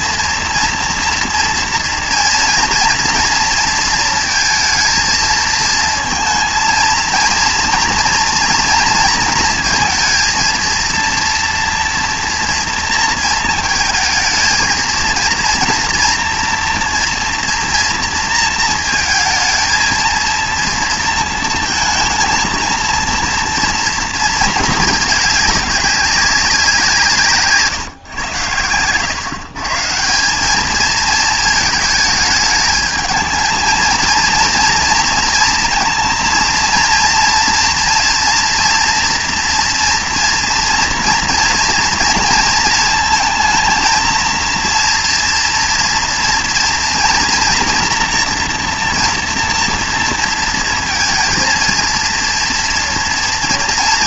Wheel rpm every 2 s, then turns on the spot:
240, 230, 230, 230, 230, 230, 230, 220, 230, 230, 230, 230, 220, 170, 100, 210, 220, 230, 230, 240, 240, 220, 230, 230, 230, 230, 230.
none